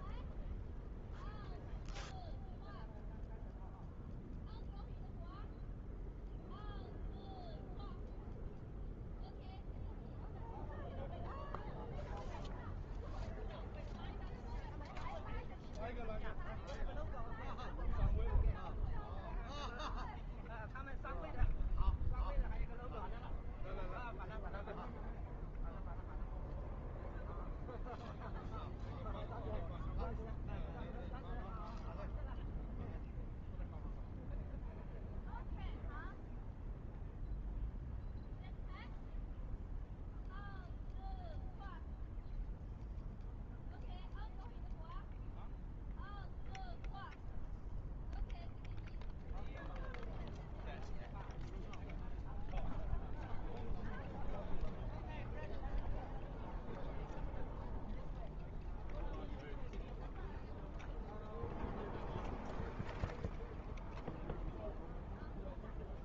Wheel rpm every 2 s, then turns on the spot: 0, 0, 0, 0, 0, 0, 0, 0, 0, 0, 0, 0, 0, 0, 0, 0, 0, 0, 0, 0, 0, 0, 0, 0, 0, 0, 0, 0, 0, 0, 0, 0, 0.
none